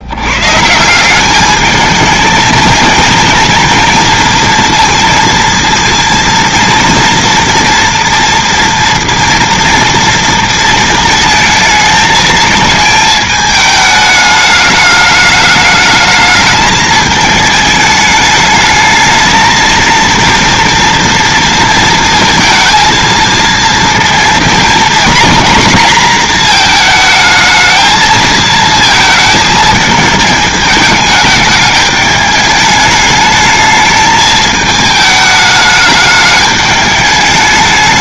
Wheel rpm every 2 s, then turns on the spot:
150, 220, 230, 230, 230, 230, 220, 210, 220, 220, 230, 230, 230, 230, 220, 220, 210, 220, 210.
none